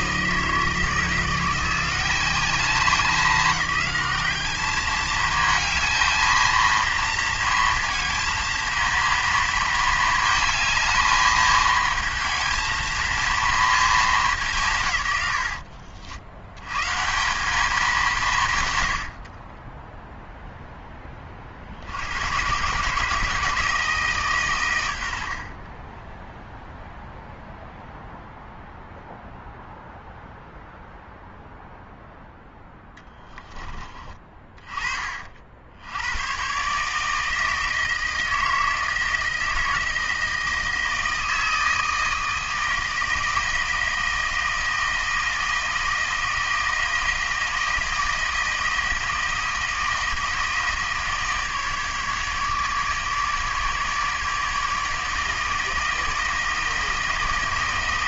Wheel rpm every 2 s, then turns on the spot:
160, 200, 210, 230, 230, 220, 230, 160, 120, 110, 10, 140, 120, 0, 0, 0, 0, 30, 130, 160, 160, 160, 160, 160, 160, 160, 150, 150, 160.
none